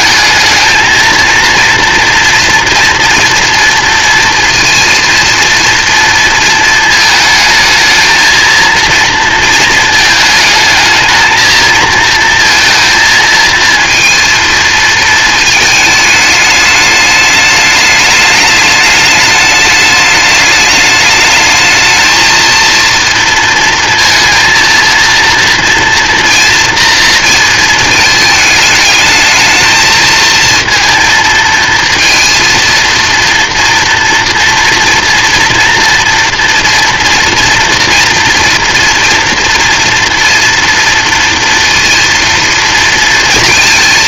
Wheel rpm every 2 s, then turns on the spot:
220, 230, 230, 220, 230, 220, 230, 230, 210, 210, 210, 230, 230, 230, 220, 230, 230, 240, 240, 230, 230, 230.
none